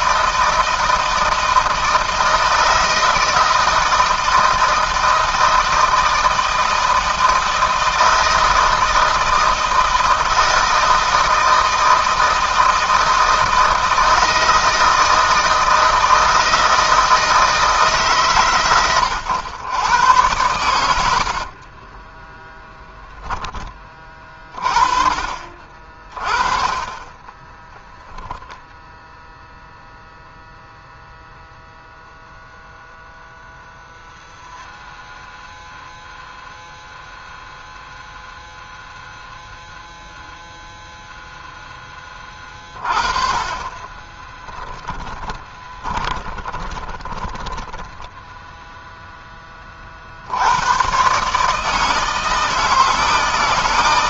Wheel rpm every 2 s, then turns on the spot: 160, 160, 160, 160, 160, 160, 160, 160, 160, 130, 100, 20, 30, 40, 10, 0, 0, 0, 0, 0, 0, 30, 10, 10, 0, 100, 160.
20-24 44-48